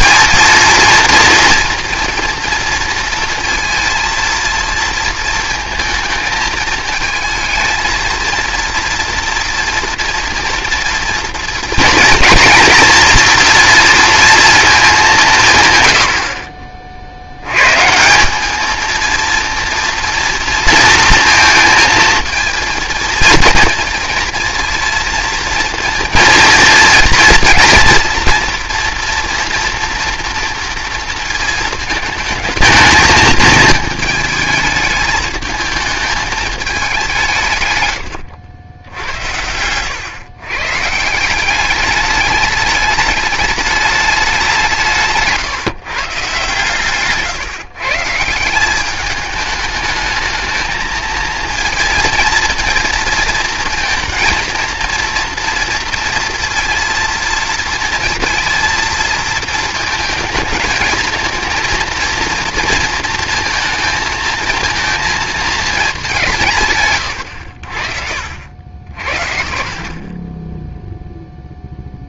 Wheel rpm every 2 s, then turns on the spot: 230, 230, 230, 220, 230, 230, 230, 220, 50, 220, 230, 230, 230, 230, 230, 230, 220, 220, 210, 80, 130, 210, 170, 140, 190, 220, 220, 230, 230, 220, 230, 230, 230, 140, 70, 10.
66-68